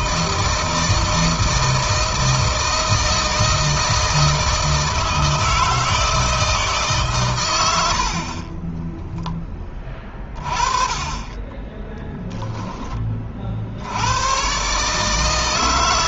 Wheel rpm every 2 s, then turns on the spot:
160, 160, 160, 140, 20, 30, 20, 140.
8-10